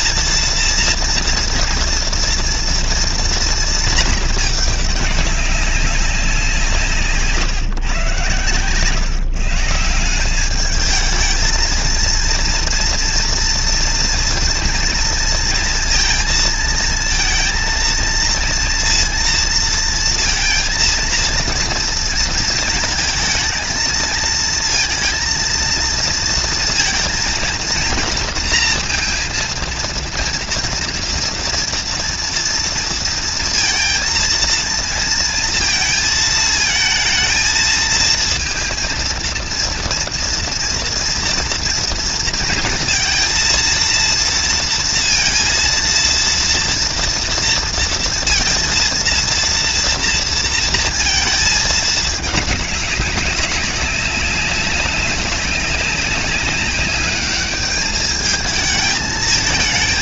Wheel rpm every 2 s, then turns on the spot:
230, 230, 210, 170, 130, 210, 230, 230, 230, 230, 230, 230, 230, 230, 230, 230, 230, 230, 220, 230, 230, 230, 230, 230, 230, 230, 210, 200, 200, 220.
8-10